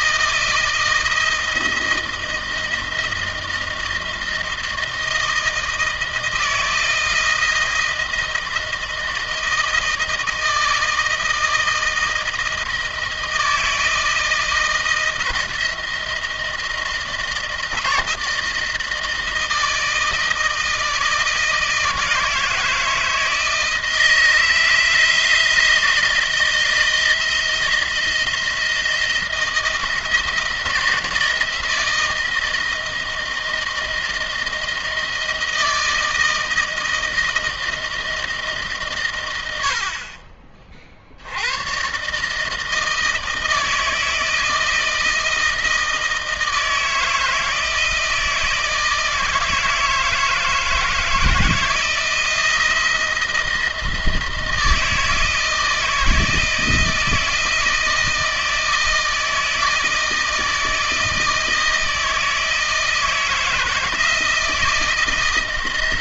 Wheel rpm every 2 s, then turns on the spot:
160, 160, 160, 160, 160, 160, 160, 160, 160, 160, 160, 160, 160, 160, 160, 160, 160, 160, 160, 120, 50, 160, 160, 160, 160, 160, 170, 160, 160, 160, 160, 160, 160.
none